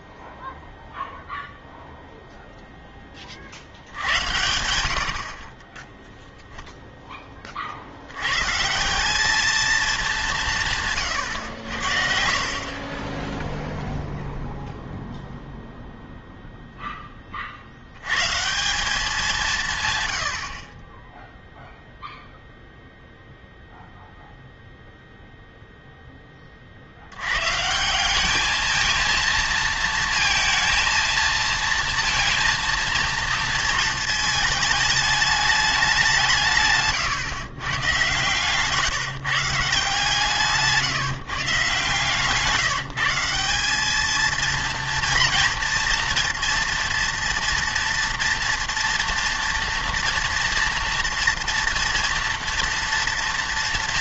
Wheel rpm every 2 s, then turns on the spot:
0, 0, 80, 0, 160, 160, 40, 0, 0, 180, 30, 0, 0, 50, 220, 230, 230, 210, 140, 140, 160, 160, 230, 230, 230, 230, 230.
36-38